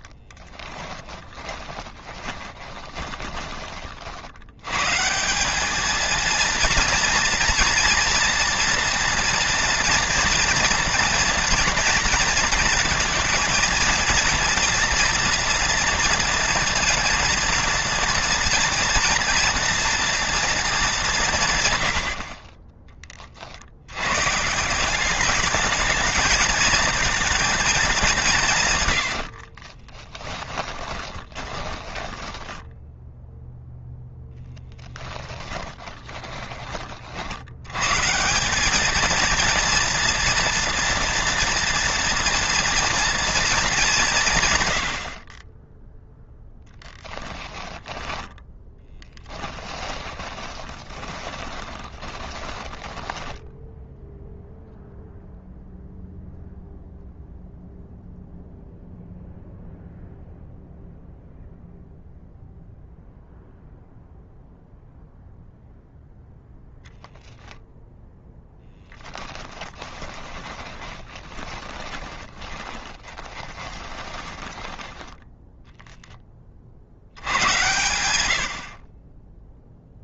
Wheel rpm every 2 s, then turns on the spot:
20, 30, 140, 230, 230, 230, 230, 240, 230, 230, 200, 30, 180, 220, 90, 20, 10, 10, 40, 220, 230, 230, 80, 10, 10, 20, 10, 0, 0, 0, 0, 0, 0, 0, 10, 20, 20, 10, 80, 40.
0-4 28-32 34-36 48-54 68-74